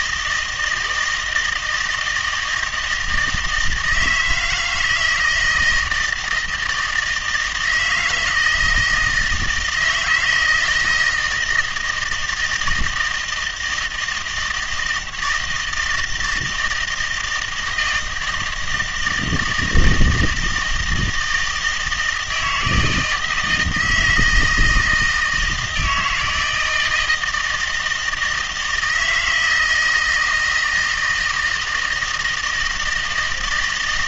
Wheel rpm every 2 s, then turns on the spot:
160, 170, 160, 160, 160, 160, 160, 160, 160, 160, 160, 160, 160, 160, 160, 160, 160.
none